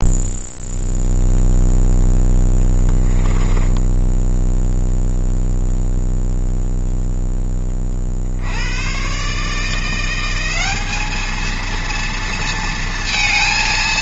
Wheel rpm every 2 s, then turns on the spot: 0, 10, 0, 0, 130, 210, 230.
2-4